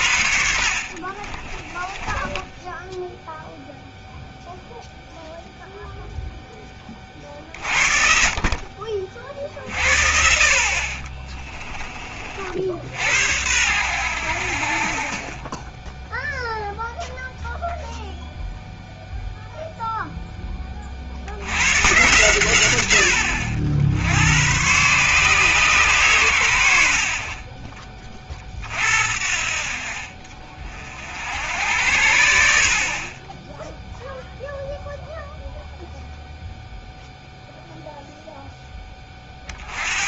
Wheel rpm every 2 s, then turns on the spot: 60, 10, 0, 30, 40, 40, 70, 40, 0, 0, 40, 100, 130, 60, 50, 50, 50, 0, 0, 20.
0-4 10-12